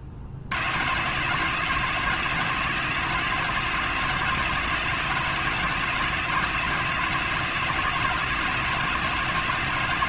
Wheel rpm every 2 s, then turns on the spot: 100, 170, 170, 170, 170.
none